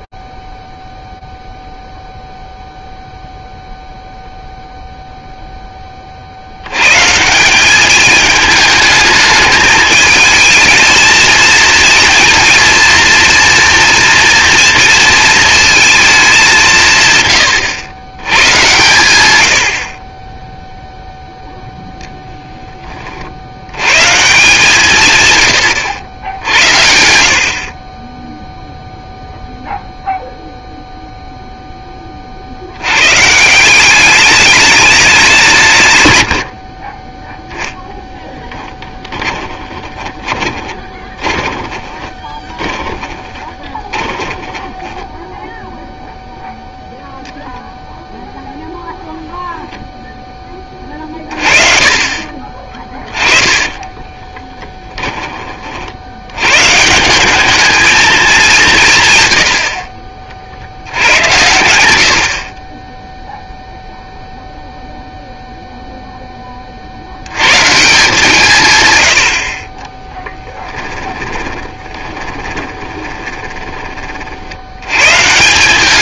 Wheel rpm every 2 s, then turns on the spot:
0, 0, 0, 60, 210, 220, 230, 230, 200, 110, 10, 10, 150, 80, 0, 0, 100, 200, 50, 20, 20, 20, 10, 0, 0, 20, 20, 20, 140, 160, 80, 20, 0, 50, 110, 10, 20, 90.
38-46 52-56 70-74